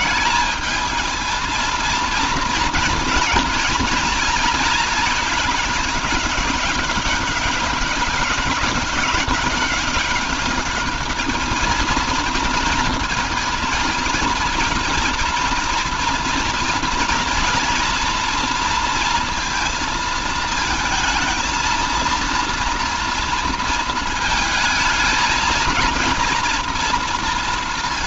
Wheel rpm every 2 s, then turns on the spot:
220, 230, 220, 200, 200, 210, 230, 230, 230, 230, 220, 230, 220, 240.
none